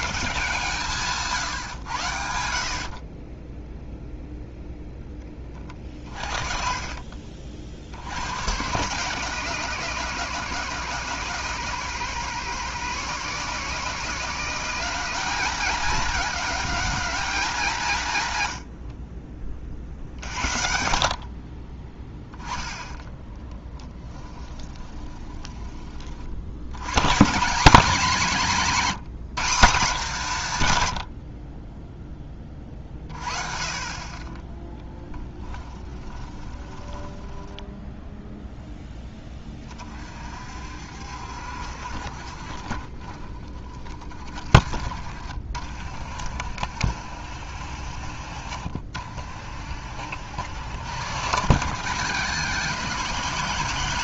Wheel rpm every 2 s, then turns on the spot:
150, 50, 0, 40, 140, 160, 170, 210, 210, 70, 60, 10, 20, 100, 190, 110, 40, 10, 20, 10, 60, 40, 50, 60, 60, 100, 160.
24-26 36-38